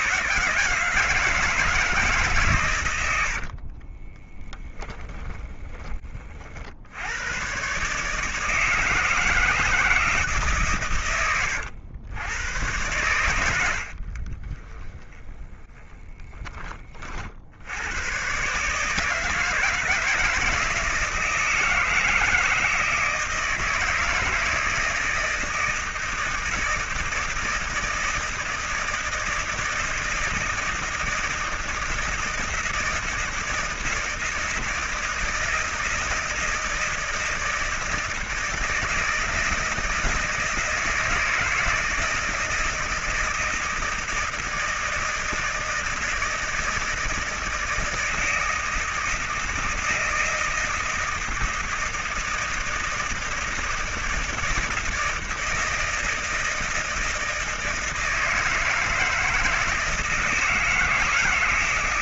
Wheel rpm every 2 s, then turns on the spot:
160, 90, 10, 90, 160, 130, 110, 20, 40, 160, 170, 160, 160, 160, 160, 160, 160, 160, 170, 160, 160, 160, 160, 160, 160, 160, 160, 160, 160, 160, 160.
4-6 14-16